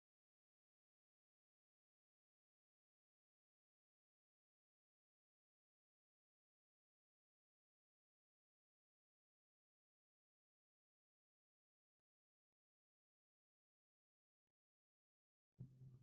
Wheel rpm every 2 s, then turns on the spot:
0, 0, 0, 0, 0, 0, 0, 0.
none